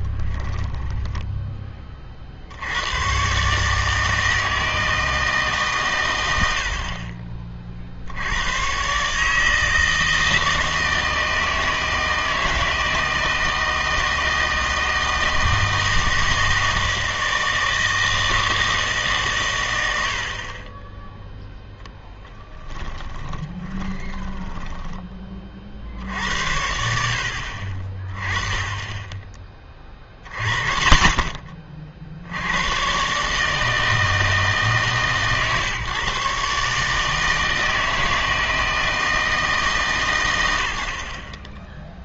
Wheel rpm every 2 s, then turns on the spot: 10, 80, 160, 60, 110, 160, 160, 160, 160, 160, 30, 10, 10, 80, 10, 30, 110, 150, 150, 160, 80.
0-2 22-26